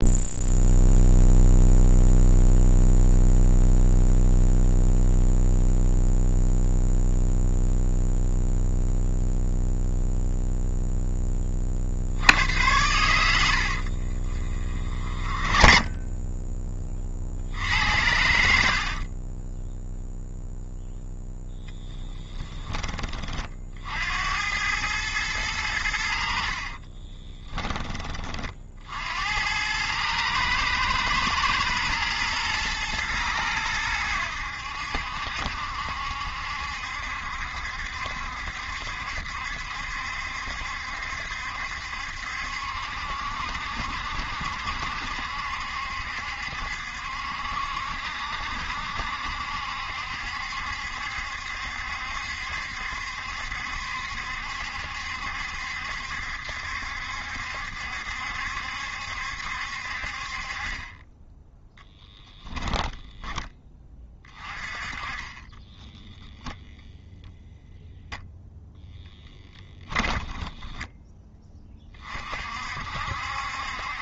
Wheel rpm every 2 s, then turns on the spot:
0, 0, 0, 0, 0, 0, 100, 40, 30, 60, 0, 20, 110, 30, 60, 110, 110, 70, 70, 70, 70, 70, 70, 60, 70, 70, 70, 70, 70, 70, 20, 10, 30, 0, 0, 10, 60.
14-16 18-20 26-28 70-72